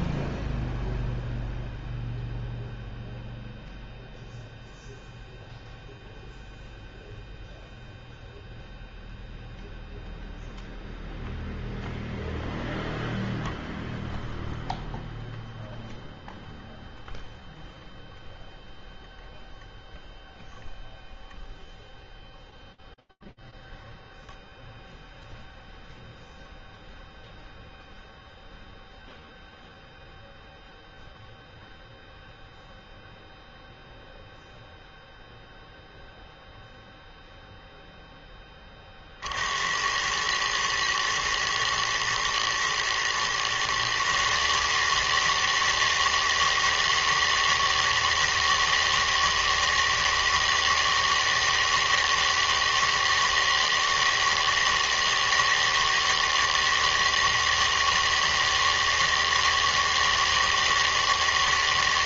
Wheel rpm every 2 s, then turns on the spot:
0, 0, 0, 0, 0, 0, 0, 0, 0, 0, 0, 0, 0, 0, 0, 0, 0, 0, 0, 50, 110, 120, 160, 160, 160, 160, 160, 160, 160, 160, 160.
none